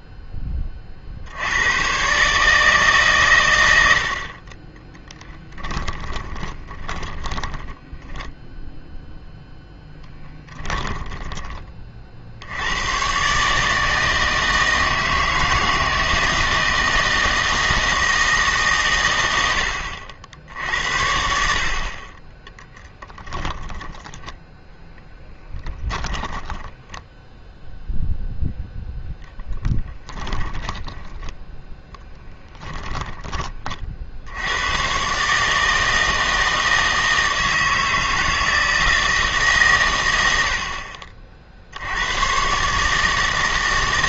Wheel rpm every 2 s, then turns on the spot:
30, 150, 20, 30, 0, 10, 100, 160, 160, 130, 70, 10, 0, 10, 0, 20, 10, 110, 160, 160, 60, 130.
6-8 10-12 26-28 30-34